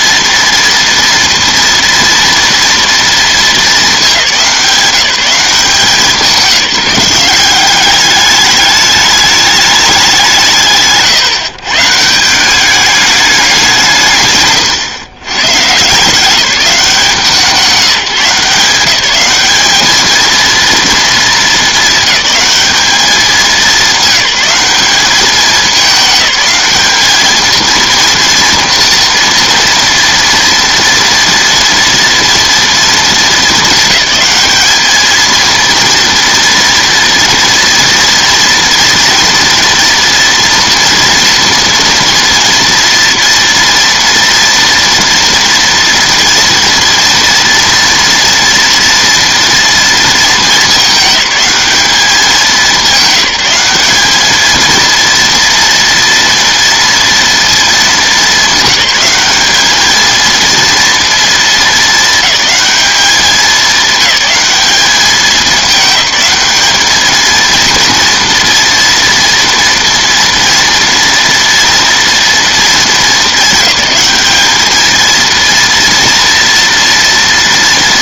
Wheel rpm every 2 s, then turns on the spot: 230, 230, 180, 190, 210, 150, 200, 130, 170, 180, 230, 210, 200, 200, 230, 240, 230, 210, 230, 230, 240, 230, 230, 230, 230, 210, 190, 230, 230, 210, 230, 210, 200, 210, 230, 230, 220, 210, 230.
none